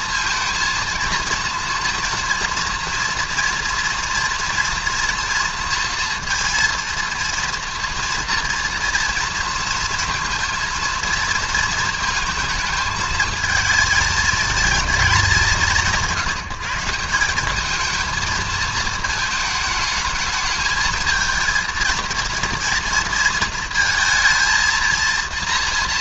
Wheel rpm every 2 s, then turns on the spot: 230, 230, 230, 230, 230, 230, 230, 220, 170, 220, 220, 230, 220.
none